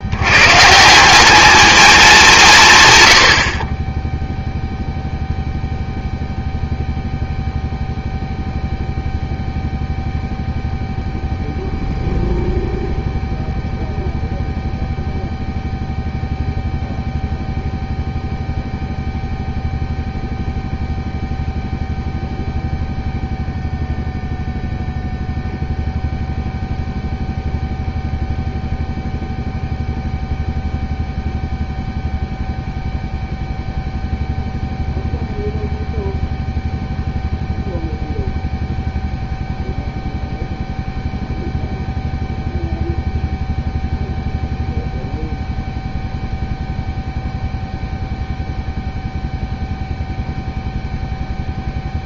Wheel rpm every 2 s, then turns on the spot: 160, 140, 0, 0, 0, 0, 0, 0, 0, 0, 0, 0, 0, 0, 0, 0, 0, 0, 0, 0, 0, 0, 0, 0, 0, 0.
none